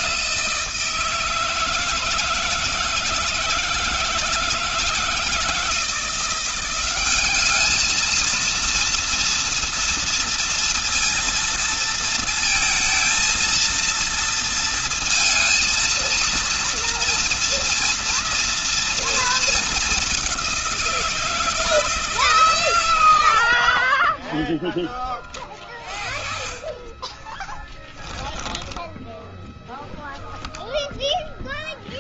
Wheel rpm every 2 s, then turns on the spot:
180, 160, 160, 180, 220, 230, 230, 230, 230, 230, 200, 150, 20, 30, 10, 0.
24-28